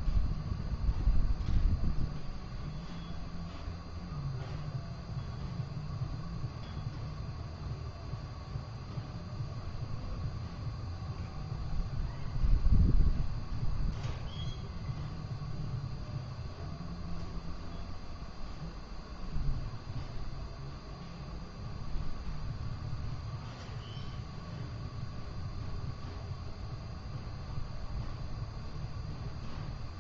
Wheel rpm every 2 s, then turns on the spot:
0, 0, 0, 0, 0, 0, 0, 0, 0, 0, 0, 0, 0, 0, 0.
none